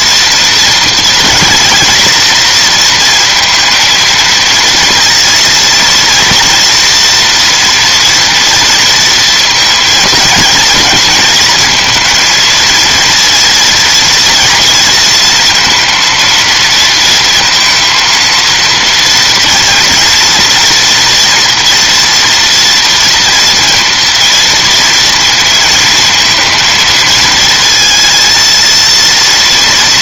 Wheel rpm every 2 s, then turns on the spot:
230, 230, 230, 230, 230, 230, 230, 230, 230, 230, 230, 230, 230, 220, 230.
none